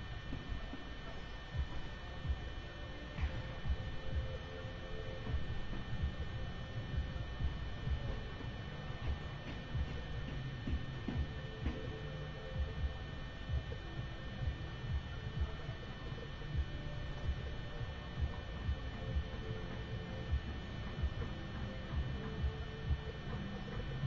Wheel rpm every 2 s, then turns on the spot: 0, 0, 0, 0, 0, 0, 0, 0, 0, 0, 0, 0.
none